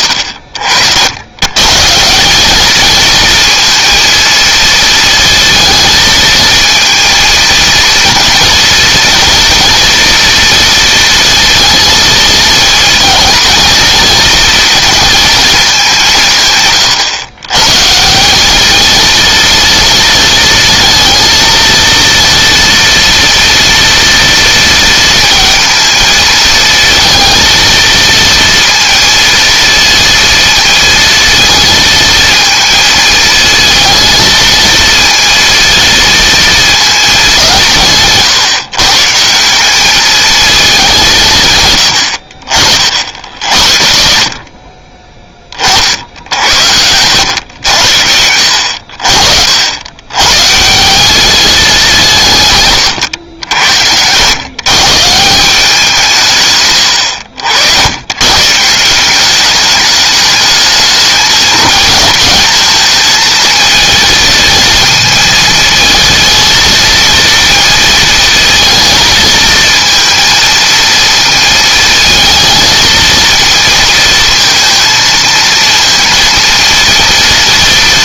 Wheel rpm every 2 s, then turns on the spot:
70, 220, 230, 230, 240, 230, 230, 230, 130, 220, 230, 230, 230, 220, 230, 230, 220, 230, 220, 130, 190, 60, 20, 100, 60, 170, 130, 140, 90, 170, 210, 220, 220, 230, 230, 230, 230, 230, 230.
none